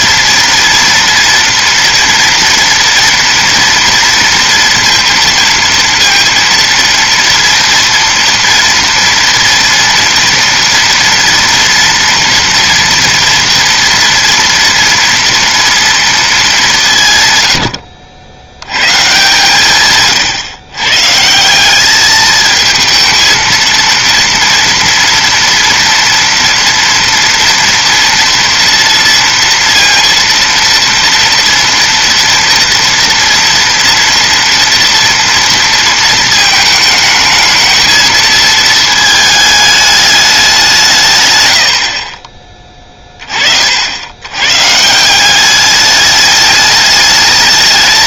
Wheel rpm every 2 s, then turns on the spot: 230, 230, 230, 230, 230, 230, 240, 230, 180, 120, 130, 220, 230, 230, 230, 230, 230, 230, 220, 220, 170, 20, 140, 210.
none